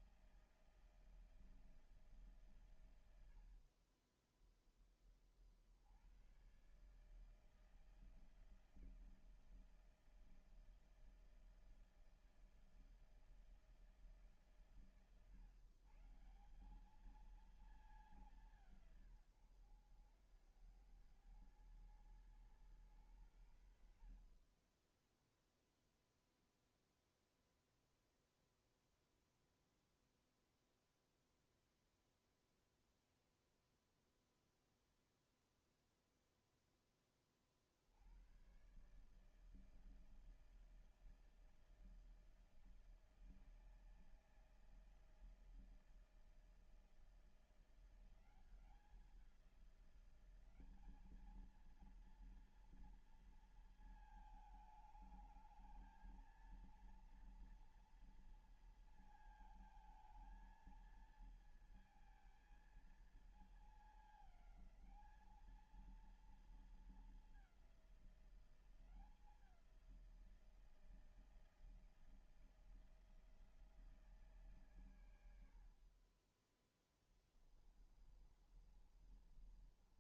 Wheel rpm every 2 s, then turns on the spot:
160, 110, 20, 140, 160, 160, 160, 140, 190, 160, 90, 110, 20, 0, 0, 0, 0, 0, 10, 130, 160, 160, 160, 160, 180, 200, 230, 220, 230, 230, 220, 220, 210, 220, 180, 170, 160, 100, 10, 30.
76-80